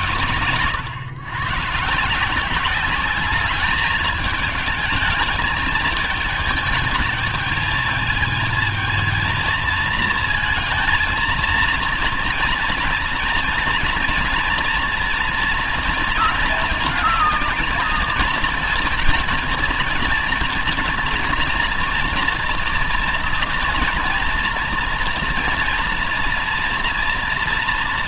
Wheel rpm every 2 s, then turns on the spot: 100, 180, 210, 220, 220, 230, 230, 230, 230, 230, 230, 230, 230, 230.
none